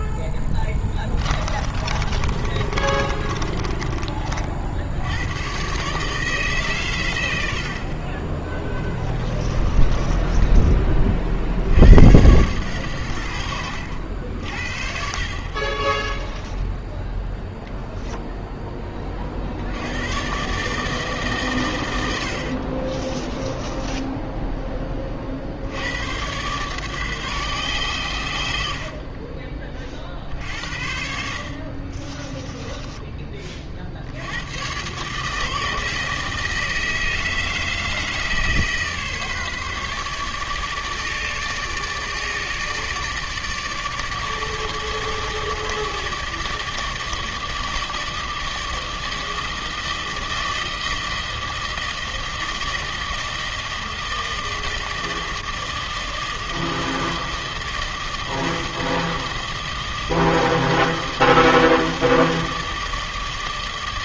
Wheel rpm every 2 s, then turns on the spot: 20, 20, 70, 120, 10, 20, 100, 60, 10, 20, 150, 40, 20, 130, 50, 60, 20, 120, 160, 150, 150, 150, 150, 160, 160, 160, 160, 160, 160, 160, 160, 160.
0-4 8-10 16-18 22-24 32-34